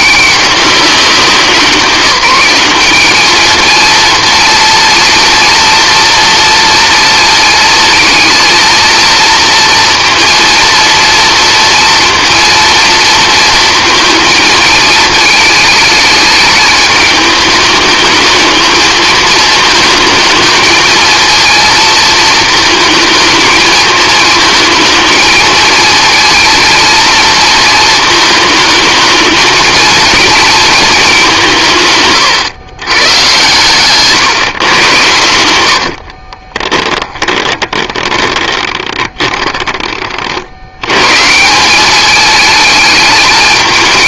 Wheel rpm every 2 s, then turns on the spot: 190, 200, 230, 230, 230, 230, 230, 220, 210, 220, 220, 220, 220, 230, 220, 220, 120, 110, 20, 20, 110, 210.
36-40